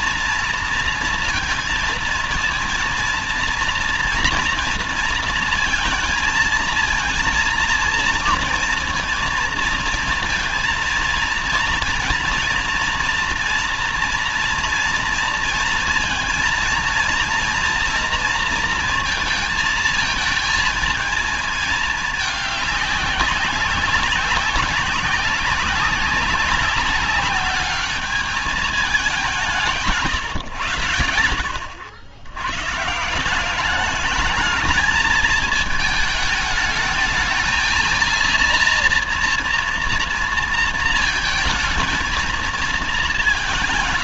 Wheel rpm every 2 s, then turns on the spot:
230, 230, 230, 230, 230, 230, 230, 230, 230, 230, 220, 200, 190, 190, 210, 110, 120, 220, 220, 230, 230, 220.
none